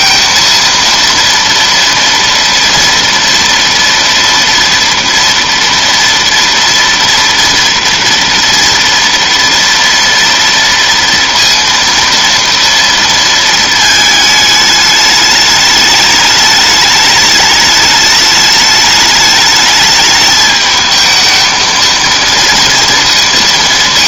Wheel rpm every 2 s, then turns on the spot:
230, 230, 230, 230, 230, 230, 230, 210, 210, 210, 220, 230.
none